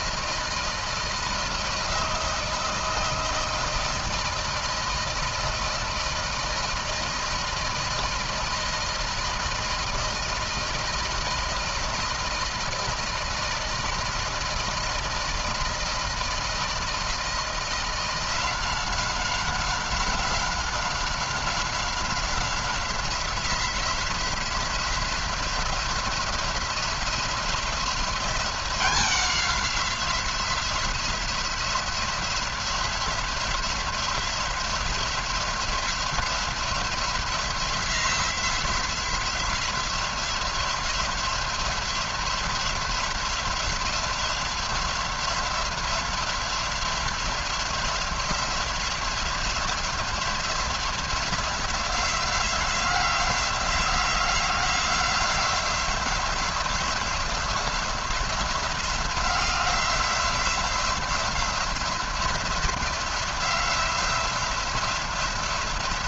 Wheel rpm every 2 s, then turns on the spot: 160, 170, 170, 170, 170, 160, 160, 160, 160, 180, 180, 180, 170, 180, 180, 180, 180, 180, 180, 180, 180, 180, 180, 180, 180, 180, 180, 180, 180, 180, 180, 180, 180.
none